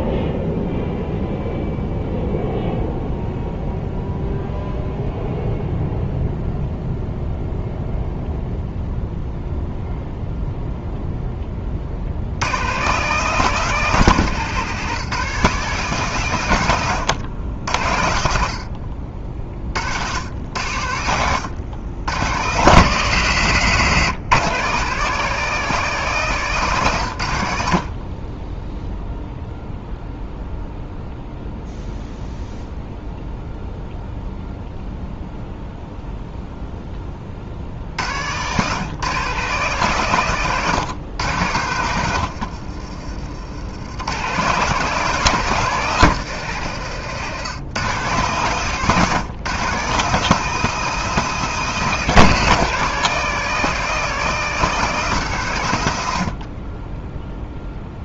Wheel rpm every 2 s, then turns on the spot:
0, 0, 0, 0, 0, 0, 120, 160, 130, 70, 90, 110, 150, 160, 10, 0, 0, 0, 0, 120, 130, 80, 150, 140, 150, 180, 170, 180, 40.
42-44